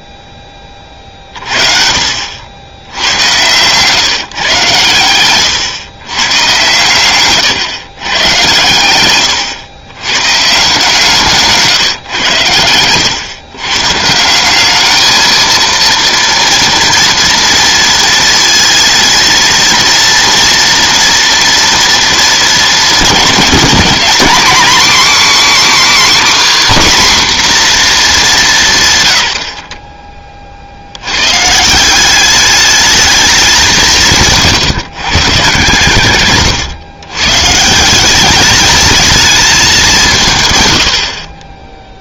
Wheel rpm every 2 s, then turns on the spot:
20, 90, 130, 120, 120, 150, 110, 200, 230, 230, 230, 210, 240, 270, 160, 50, 210, 140, 120, 210, 120.
34-36